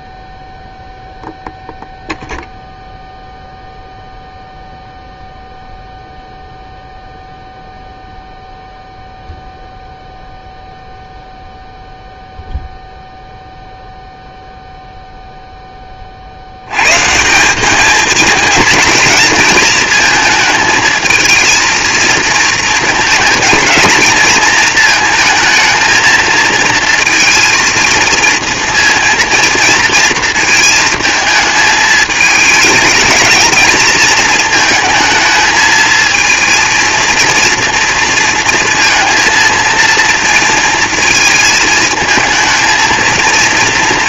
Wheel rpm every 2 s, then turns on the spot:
0, 0, 0, 0, 0, 0, 0, 0, 90, 230, 230, 220, 220, 220, 230, 220, 220, 230, 230, 230, 230, 220.
none